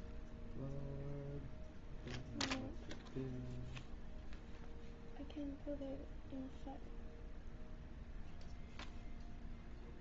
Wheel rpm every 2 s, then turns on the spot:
0, 0, 0, 0, 0.
none